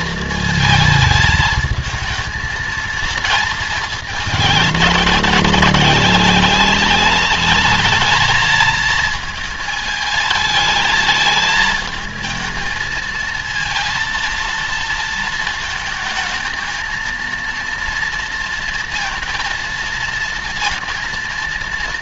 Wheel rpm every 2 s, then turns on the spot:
220, 230, 210, 200, 220, 220, 220, 230, 230, 230, 230.
none